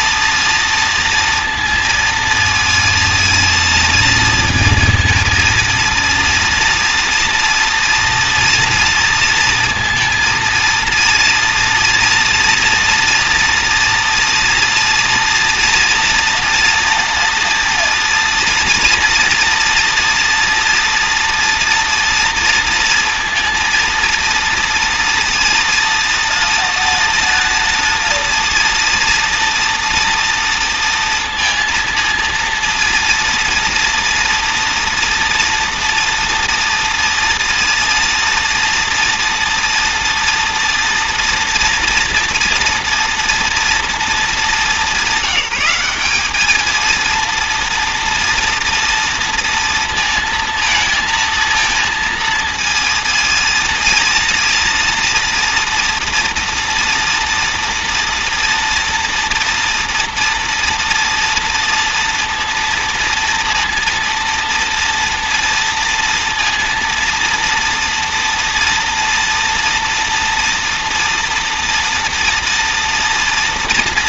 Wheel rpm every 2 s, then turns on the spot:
230, 230, 230, 230, 230, 230, 240, 240, 240, 240, 240, 230, 230, 230, 230, 230, 230, 230, 230, 230, 230, 230, 200, 220, 230, 230, 230, 230, 230, 240, 230, 230, 230, 230, 230, 230, 230.
none